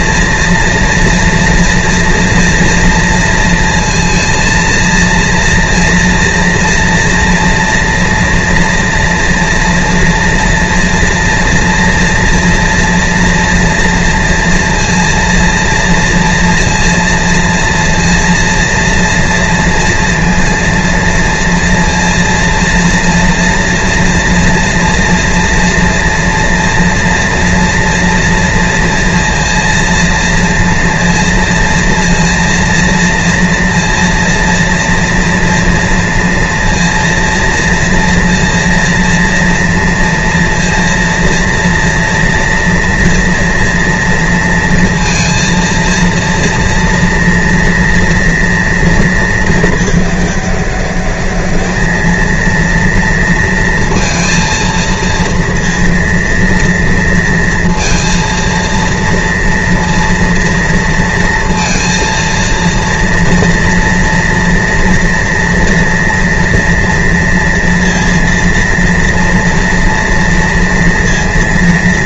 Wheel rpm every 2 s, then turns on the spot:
230, 230, 230, 230, 230, 230, 230, 230, 230, 240, 230, 230, 230, 230, 230, 230, 230, 230, 230, 230, 230, 240, 230, 230, 230, 210, 220, 230, 230, 230, 230, 230, 230, 230, 230, 230.
none